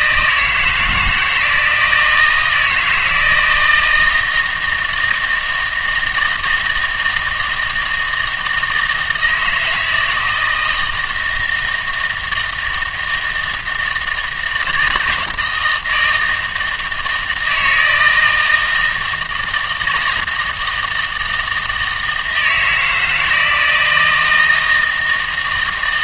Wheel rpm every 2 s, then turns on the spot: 160, 160, 170, 160, 160, 160, 160, 160, 160, 160, 160, 160, 160.
none